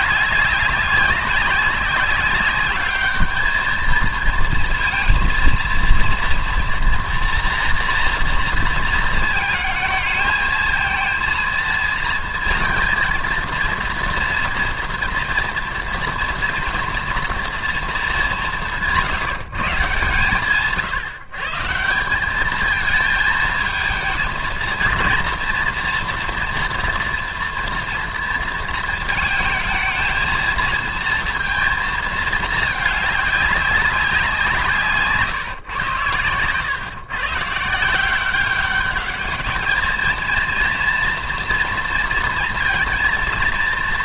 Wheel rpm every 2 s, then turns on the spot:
200, 210, 230, 240, 230, 220, 230, 230, 230, 160, 140, 220, 230, 230, 220, 230, 210, 160, 130, 200, 230, 230.
none